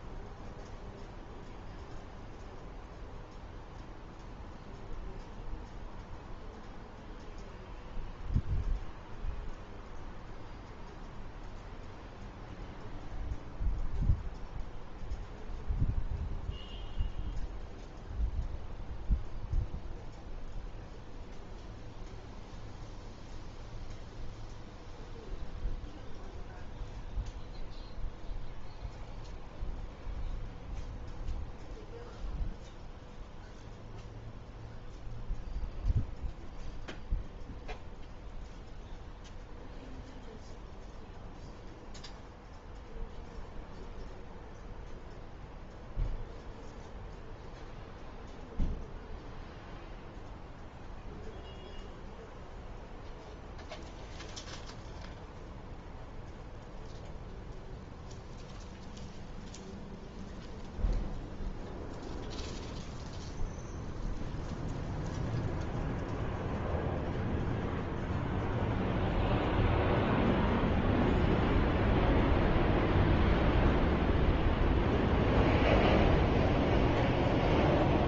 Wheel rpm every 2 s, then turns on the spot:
0, 0, 0, 0, 0, 0, 0, 0, 0, 0, 0, 0, 0, 0, 0, 0, 0, 0, 0, 0, 0, 0, 0, 0, 0, 0, 0, 0, 0, 0, 0, 0, 0, 0, 0, 0, 0, 0, 0.
none